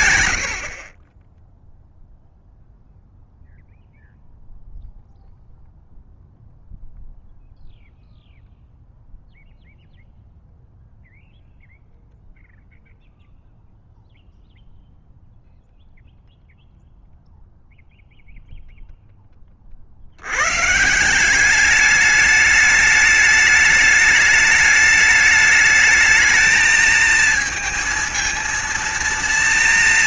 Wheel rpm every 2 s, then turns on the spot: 100, 0, 0, 0, 0, 0, 0, 0, 0, 0, 120, 210, 210, 220, 230.
none